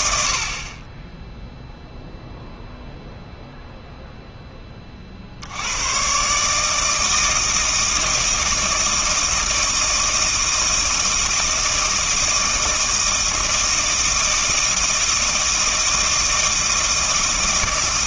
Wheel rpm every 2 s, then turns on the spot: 30, 0, 30, 160, 160, 160, 160, 160, 160.
none